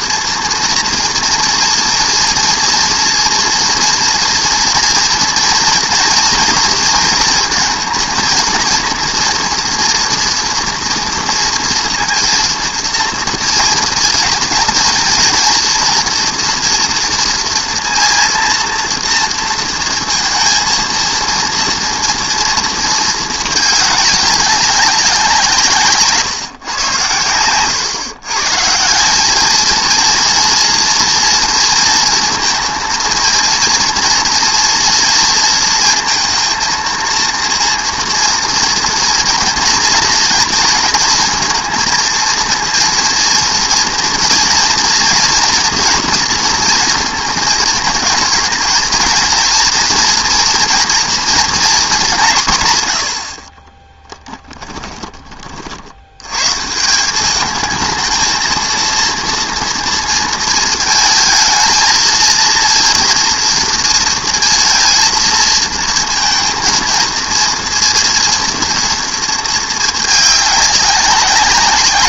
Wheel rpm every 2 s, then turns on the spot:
230, 230, 230, 230, 230, 230, 230, 220, 230, 230, 230, 230, 190, 130, 160, 230, 230, 230, 230, 230, 230, 230, 230, 230, 230, 240, 130, 20, 150, 230, 220, 230, 230, 220, 230, 200.
54-56